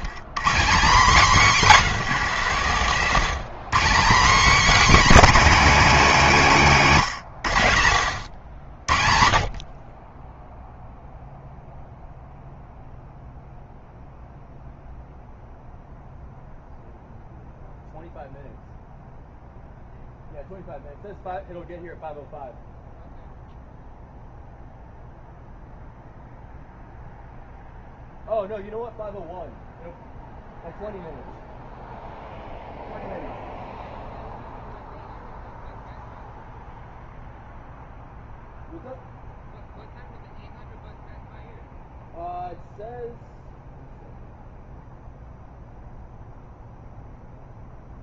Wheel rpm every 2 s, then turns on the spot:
180, 180, 250, 220, 100, 10, 0, 0, 0, 0, 0, 0, 0, 0, 0, 0, 0, 0, 0, 0, 0, 0, 0, 0.
none